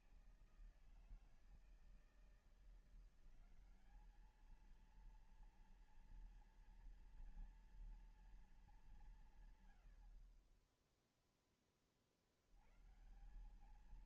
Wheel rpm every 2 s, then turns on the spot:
160, 180, 230, 240, 200, 20, 130.
none